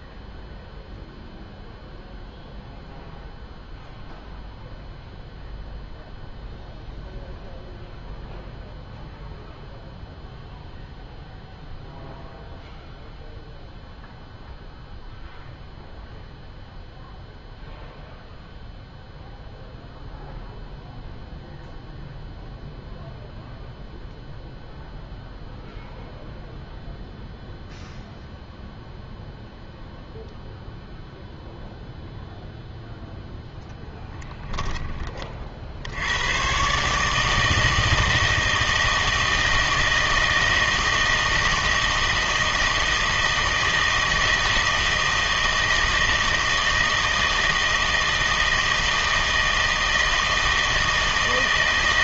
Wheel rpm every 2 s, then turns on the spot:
0, 0, 0, 0, 0, 0, 0, 0, 0, 0, 0, 0, 0, 0, 0, 0, 0, 10, 130, 160, 160, 160, 160, 160, 160, 160.
none